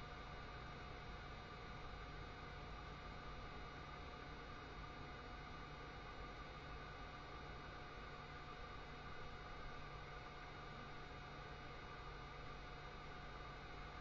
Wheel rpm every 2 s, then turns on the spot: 0, 0, 0, 0, 0, 0, 0.
none